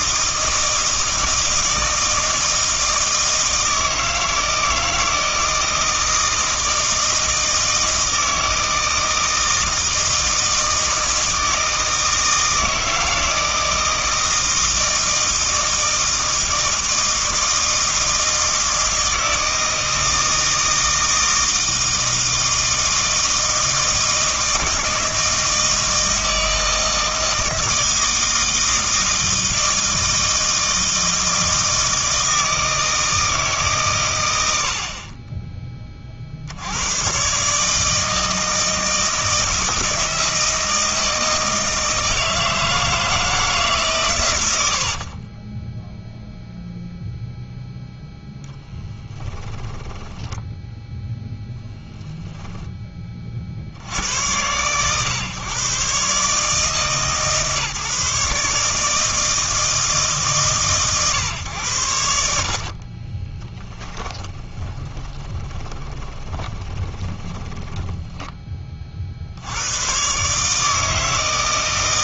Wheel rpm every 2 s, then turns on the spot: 160, 160, 160, 160, 160, 160, 160, 160, 160, 160, 160, 160, 160, 160, 160, 160, 160, 70, 90, 160, 160, 160, 70, 0, 10, 10, 10, 110, 150, 150, 140, 50, 20, 20, 20, 150.
44-46 48-52 62-68